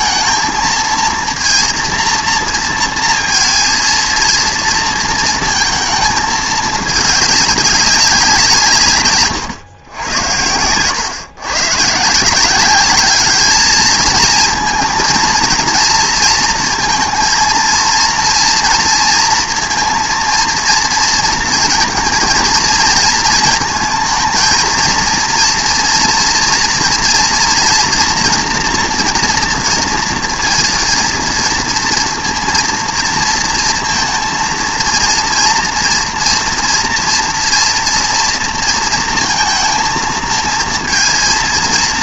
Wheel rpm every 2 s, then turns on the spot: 220, 230, 230, 210, 140, 100, 200, 230, 230, 230, 230, 230, 230, 230, 240, 230, 230, 230, 230, 230, 230.
none